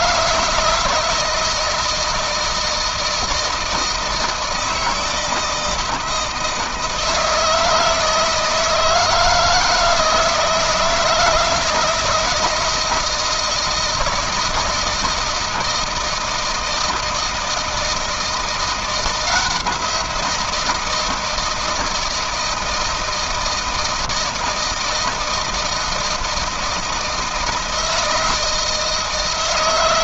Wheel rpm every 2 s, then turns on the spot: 160, 160, 160, 160, 160, 160, 160, 160, 160, 170, 170, 160, 160, 170, 160.
none